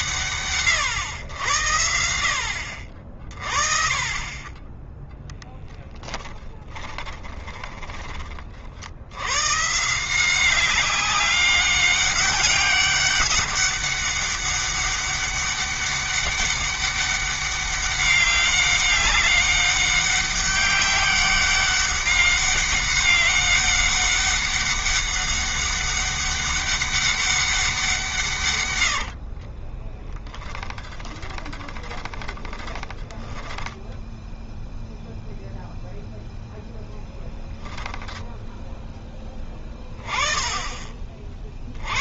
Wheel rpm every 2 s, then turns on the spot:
110, 60, 10, 20, 60, 190, 200, 200, 200, 200, 200, 200, 200, 200, 100, 10, 20, 0, 0, 10, 30.
6-8 28-34